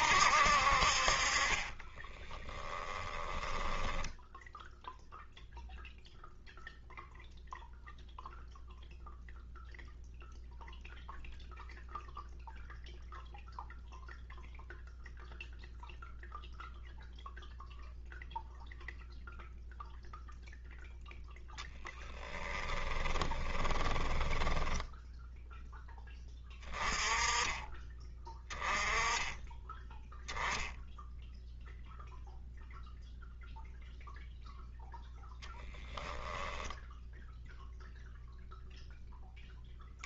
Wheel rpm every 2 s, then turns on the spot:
60, 40, 0, 0, 0, 0, 0, 0, 0, 0, 0, 20, 10, 20, 10, 0, 0, 0, 0, 0.
2-4 22-26